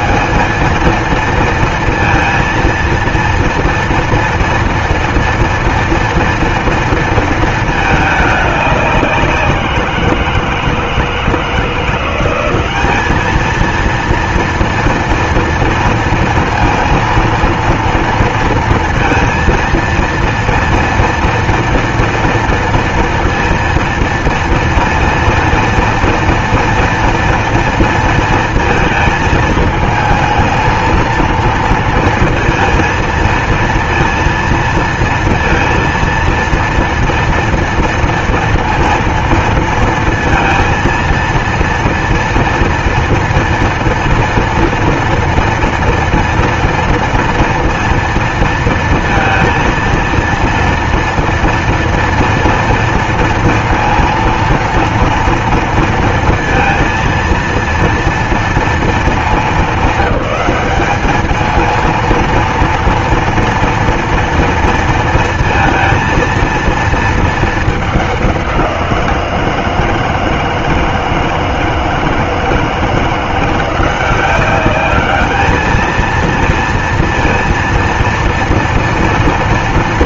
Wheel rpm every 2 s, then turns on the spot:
210, 230, 230, 230, 210, 170, 180, 230, 230, 230, 230, 230, 230, 230, 230, 220, 230, 230, 230, 230, 230, 230, 230, 230, 230, 230, 230, 230, 230, 230, 200, 230, 230, 230, 190, 160, 160, 190, 230, 230.
none